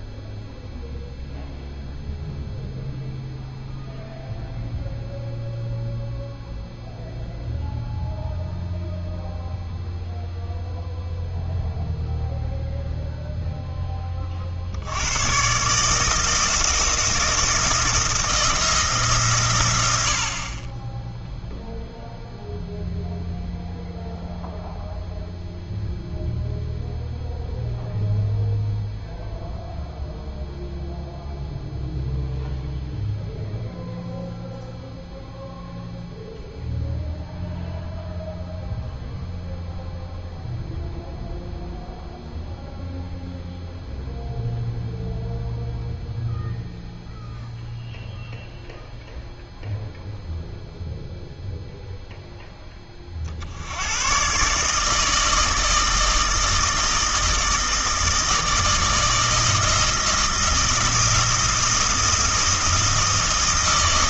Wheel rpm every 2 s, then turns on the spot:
0, 0, 0, 0, 0, 0, 0, 70, 170, 160, 20, 0, 0, 0, 0, 0, 0, 0, 0, 0, 0, 0, 0, 0, 0, 0, 30, 150, 160, 160, 160, 160.
none